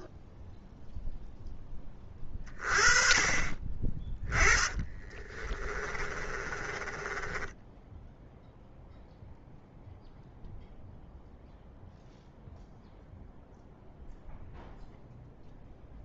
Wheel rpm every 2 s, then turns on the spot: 0, 30, 30, 20, 0, 0, 0, 0.
4-8